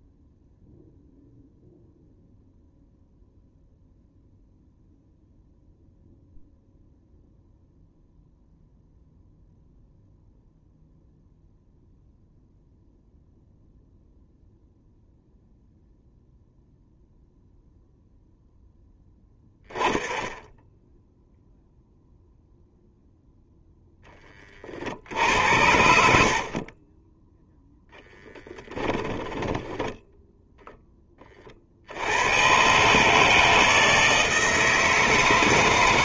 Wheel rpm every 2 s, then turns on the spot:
0, 0, 0, 0, 0, 0, 0, 0, 0, 10, 0, 0, 50, 30, 10, 10, 140, 160.
26-30